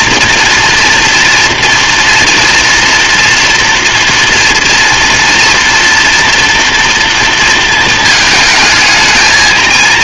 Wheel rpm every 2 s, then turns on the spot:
230, 240, 230, 230, 220.
none